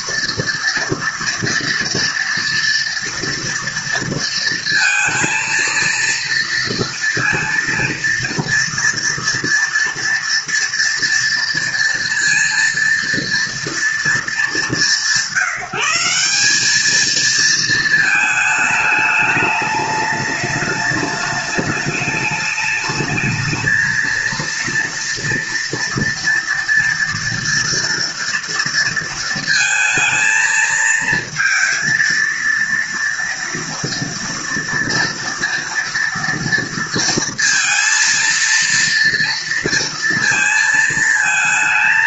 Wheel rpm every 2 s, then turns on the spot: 230, 230, 230, 230, 230, 230, 230, 200, 200, 220, 210, 210, 230, 230, 230, 220, 230, 230, 230, 230, 220.
none